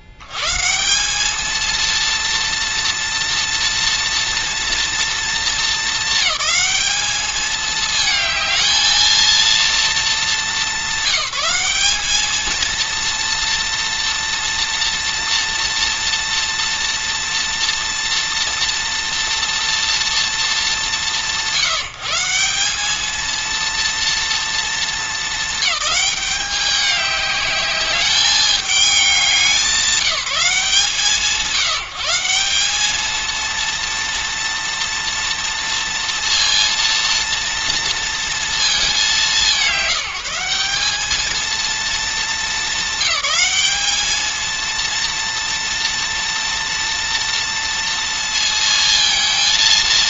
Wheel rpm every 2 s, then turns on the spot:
80, 230, 230, 210, 220, 190, 230, 230, 230, 230, 210, 180, 230, 200, 210, 170, 210, 230, 230, 210, 190, 200, 230, 240, 230.
none